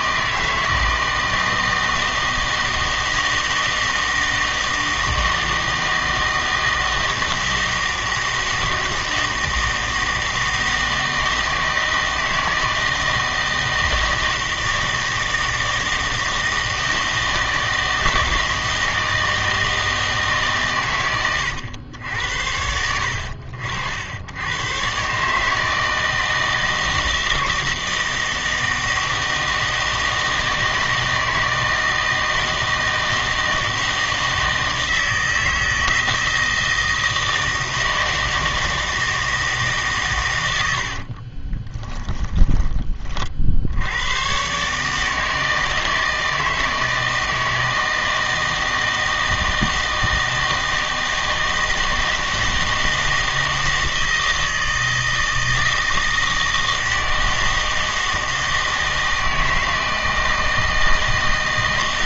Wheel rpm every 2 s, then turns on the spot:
160, 170, 160, 160, 160, 160, 160, 160, 160, 160, 130, 80, 110, 160, 160, 160, 160, 160, 160, 160, 100, 20, 130, 160, 160, 160, 160, 160, 160, 160, 160.
none